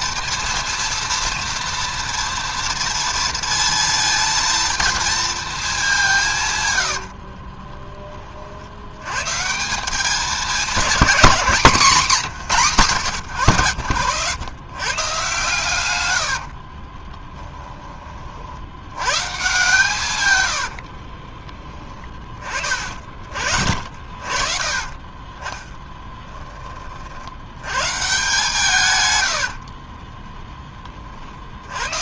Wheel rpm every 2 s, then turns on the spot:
230, 230, 230, 80, 90, 210, 130, 130, 30, 90, 60, 40, 40, 40, 130, 40.
6-8 16-18 20-22